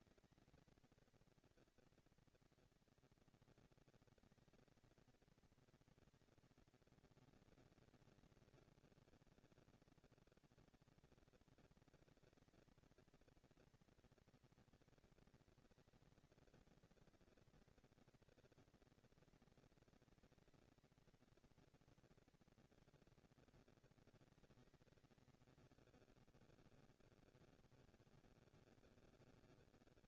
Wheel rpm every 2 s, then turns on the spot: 220, 230, 230, 230, 190, 190, 230, 230, 230, 240, 230, 230, 220, 180, 180.
none